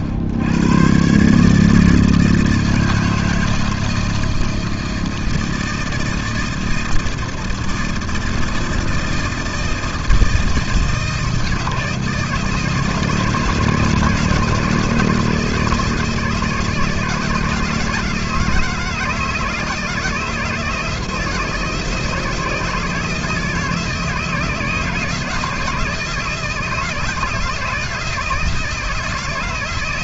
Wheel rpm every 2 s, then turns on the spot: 80, 160, 160, 160, 160, 160, 160, 160, 160, 160, 160, 160, 160, 170, 160.
none